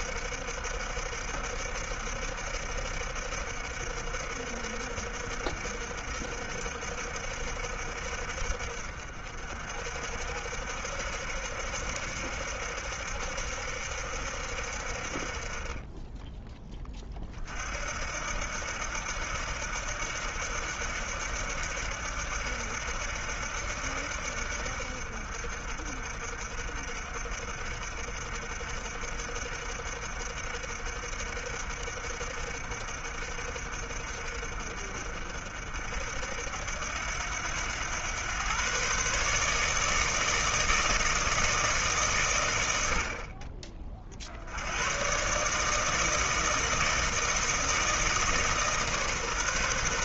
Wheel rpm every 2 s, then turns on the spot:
60, 60, 60, 60, 50, 70, 70, 50, 20, 80, 80, 70, 60, 60, 60, 60, 60, 60, 80, 130, 160, 70, 100, 160, 150.
none